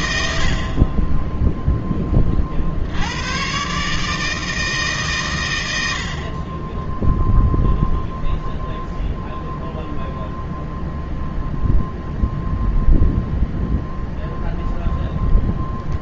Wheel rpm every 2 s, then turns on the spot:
50, 90, 140, 0, 0, 0, 0, 0.
none